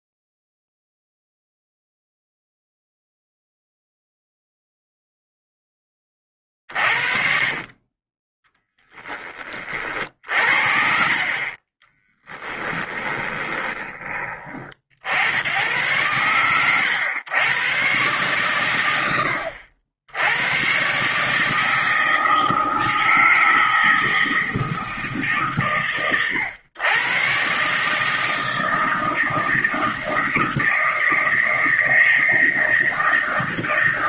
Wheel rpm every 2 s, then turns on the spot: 0, 0, 0, 50, 20, 50, 20, 60, 110, 70, 130, 160, 140, 120, 160, 160, 160.
6-8 10-14